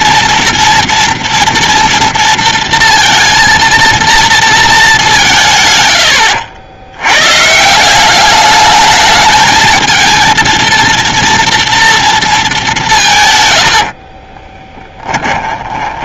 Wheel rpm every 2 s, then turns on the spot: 230, 230, 200, 110, 210, 230, 180, 10.
14-16